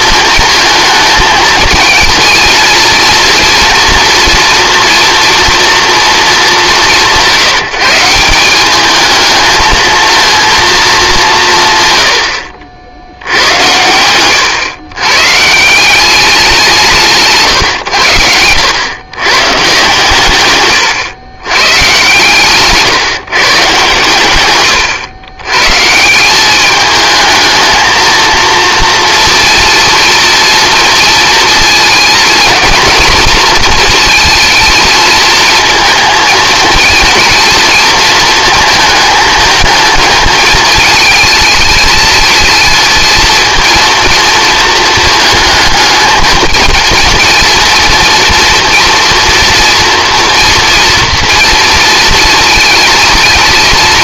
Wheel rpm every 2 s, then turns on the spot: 220, 230, 240, 190, 200, 230, 80, 120, 180, 100, 110, 140, 120, 210, 230, 230, 230, 230, 220, 230, 220, 220, 220, 220, 230, 230, 230.
none